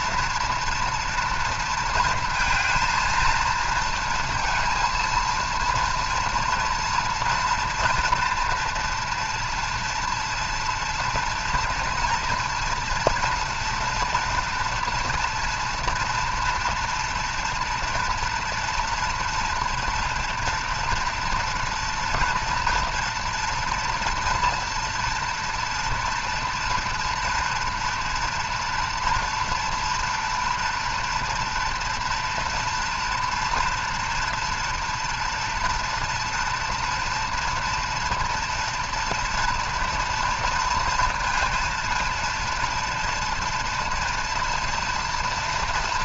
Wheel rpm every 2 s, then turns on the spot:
230, 230, 230, 230, 230, 240, 240, 240, 230, 240, 230, 240, 230, 230, 230, 230, 230, 230, 230, 230, 230, 230, 240.
none